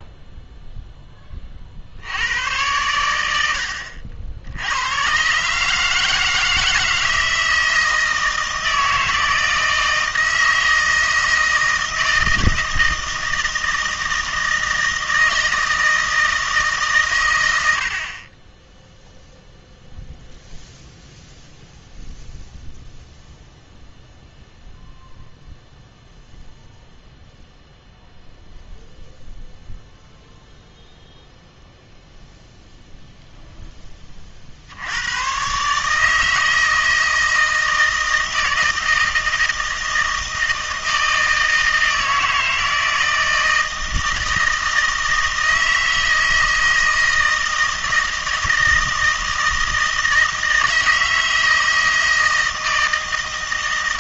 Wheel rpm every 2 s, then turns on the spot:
0, 100, 80, 160, 160, 160, 160, 160, 150, 10, 0, 0, 0, 0, 0, 0, 0, 60, 160, 160, 160, 160, 160, 160, 160, 160, 160.
none